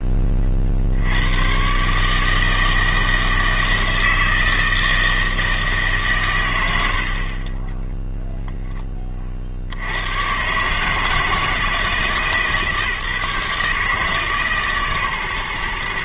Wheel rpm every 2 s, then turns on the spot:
50, 160, 160, 100, 10, 130, 150, 140.
none